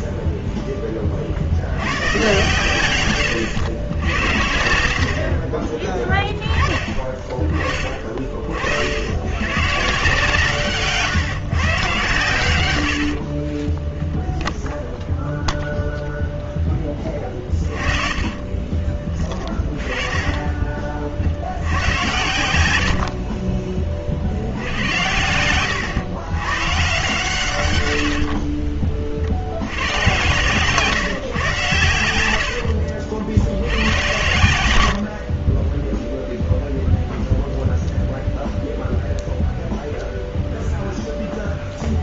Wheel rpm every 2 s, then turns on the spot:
10, 120, 70, 20, 80, 150, 80, 0, 20, 20, 40, 60, 90, 130, 40, 140, 60, 80, 0, 0, 0.
10-14 16-18 24-26 32-34